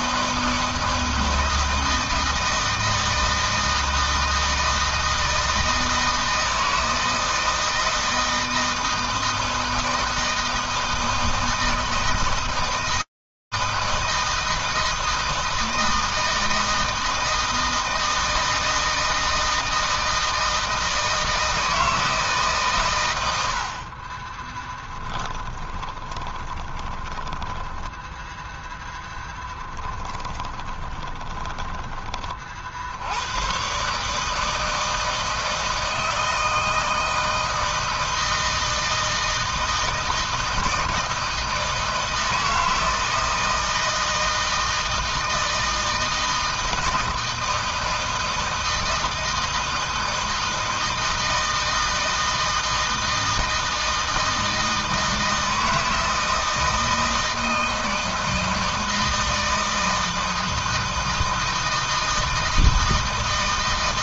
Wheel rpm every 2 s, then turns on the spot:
160, 160, 160, 160, 160, 160, 160, 160, 160, 160, 160, 120, 10, 20, 0, 20, 60, 160, 160, 160, 160, 160, 160, 160, 160, 160, 160, 160, 160, 160, 160, 160.
24-28 30-32